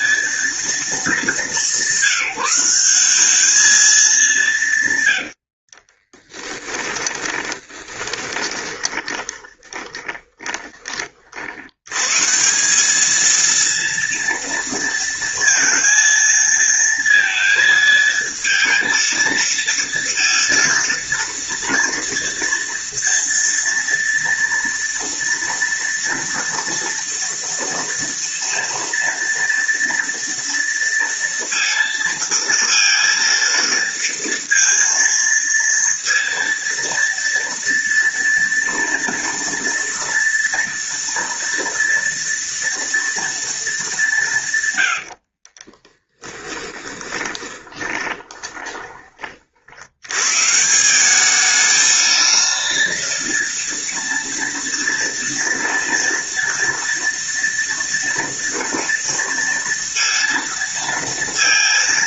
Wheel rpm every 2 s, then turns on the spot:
210, 200, 100, 20, 10, 40, 220, 230, 230, 230, 230, 230, 230, 230, 230, 230, 230, 230, 230, 230, 230, 230, 60, 20, 30, 200, 230, 230, 230, 230, 230.
4-10 44-48